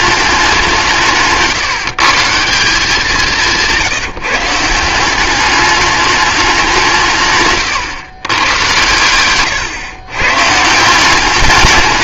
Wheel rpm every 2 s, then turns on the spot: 180, 180, 160, 190, 110, 150.
none